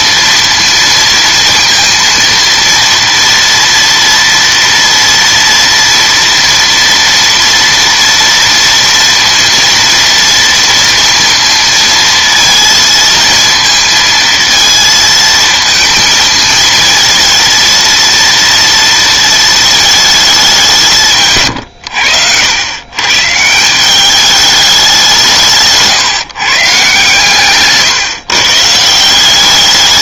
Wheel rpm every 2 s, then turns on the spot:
230, 230, 240, 240, 230, 230, 230, 230, 230, 230, 170, 110, 190, 130, 160.
none